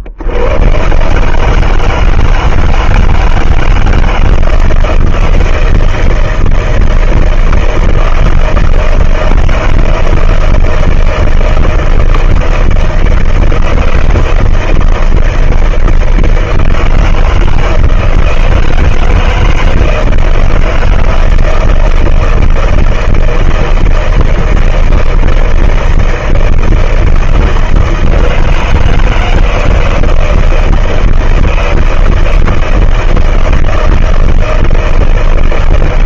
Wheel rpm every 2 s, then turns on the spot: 50, 160, 160, 160, 160, 170, 160, 160, 160, 160, 160, 160, 160, 160, 160, 160, 160, 160.
none